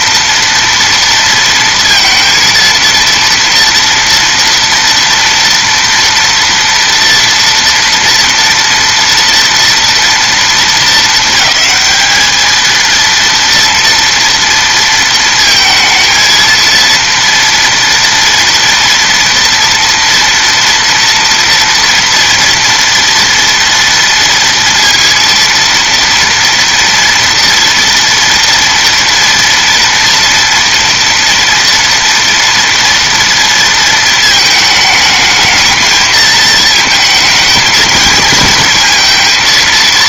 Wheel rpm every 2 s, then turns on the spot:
240, 230, 240, 230, 230, 230, 220, 230, 230, 230, 230, 230, 230, 230, 230, 230, 230, 220, 220, 230.
none